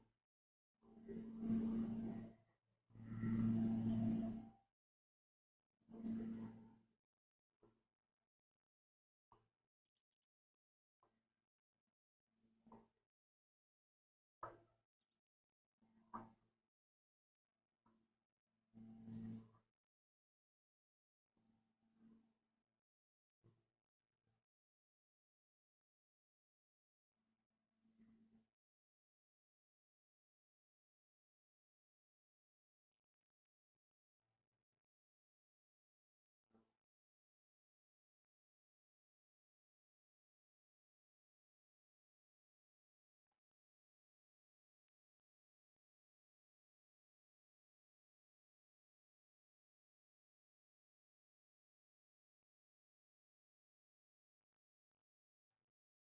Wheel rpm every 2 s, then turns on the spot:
0, 0, 0, 0, 0, 0, 0, 0, 0, 0, 0, 0, 0, 0, 0, 0, 0, 0, 0, 0, 0, 0, 0, 0, 0, 0, 0, 0.
none